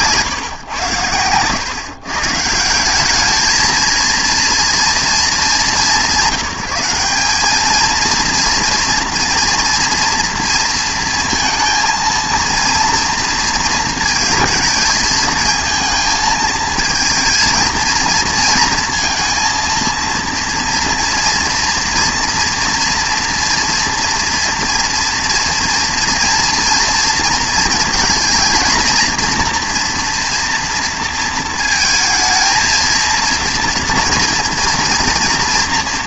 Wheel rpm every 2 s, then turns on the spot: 130, 170, 230, 180, 230, 230, 230, 220, 220, 230, 230, 230, 230, 230, 230, 230, 220, 230.
none